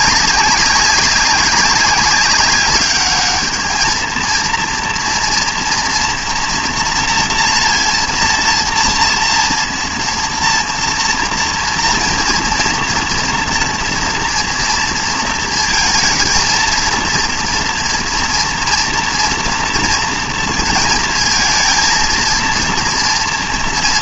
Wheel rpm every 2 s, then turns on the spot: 200, 200, 230, 240, 230, 230, 230, 230, 230, 240, 230, 230.
none